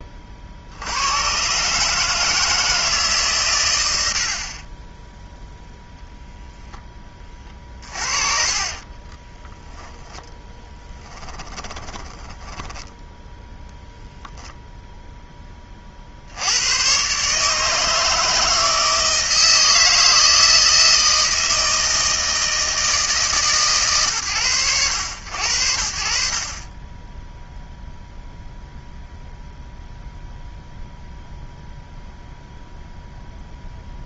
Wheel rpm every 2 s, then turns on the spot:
50, 160, 30, 0, 40, 10, 10, 0, 90, 160, 160, 160, 110, 50, 0, 0, 0.
8-14